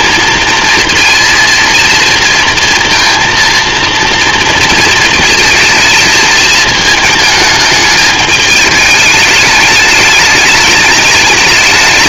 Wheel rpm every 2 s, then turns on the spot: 230, 230, 230, 220, 210, 210.
none